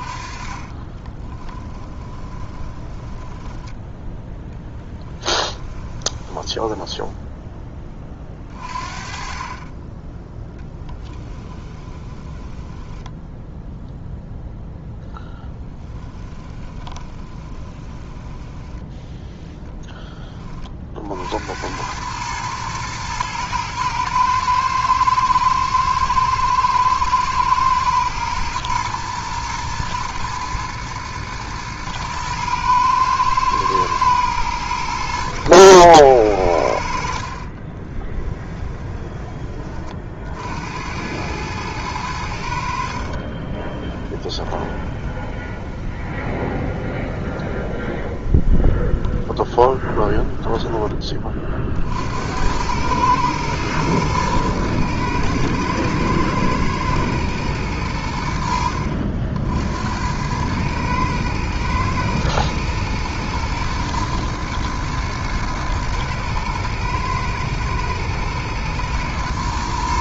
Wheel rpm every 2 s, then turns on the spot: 30, 20, 10, 10, 20, 10, 10, 0, 20, 10, 50, 110, 110, 110, 110, 110, 110, 80, 60, 20, 90, 50, 20, 20, 20, 20, 110, 110, 120, 70, 110, 110, 110, 110, 110.
0-8 10-14 16-20 38-40 42-50